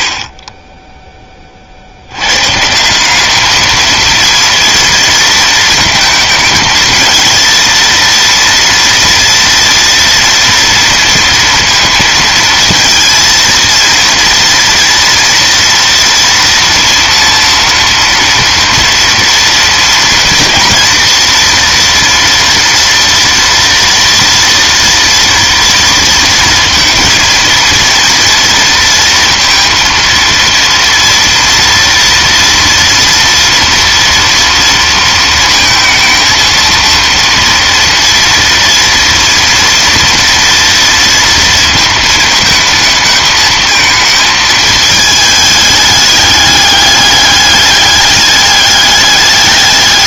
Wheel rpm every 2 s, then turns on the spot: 60, 120, 230, 220, 230, 230, 230, 230, 230, 230, 230, 230, 230, 230, 230, 230, 230, 230, 230, 230, 230, 220, 220, 210, 200.
none